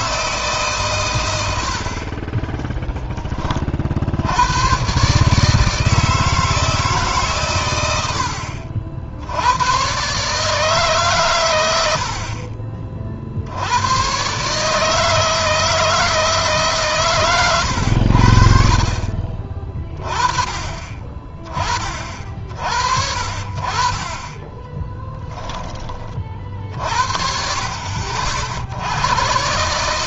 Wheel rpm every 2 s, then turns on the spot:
130, 10, 130, 150, 70, 140, 50, 160, 130, 50, 30, 50, 20, 50, 100.
24-26